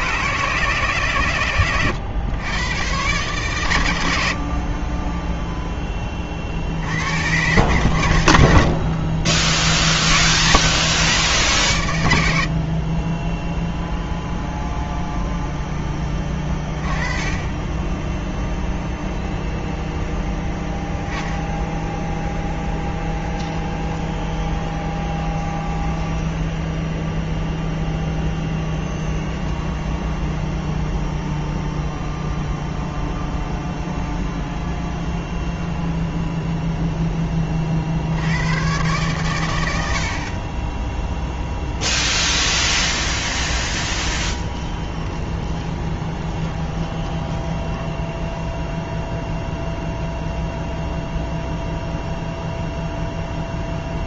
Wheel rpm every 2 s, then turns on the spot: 150, 130, 20, 100, 60, 110, 20, 0, 20, 0, 10, 10, 20, 0, 10, 0, 0, 0, 10, 120, 10, 20, 20, 20, 0, 0, 0.
4-6 8-10 22-26 28-30 42-48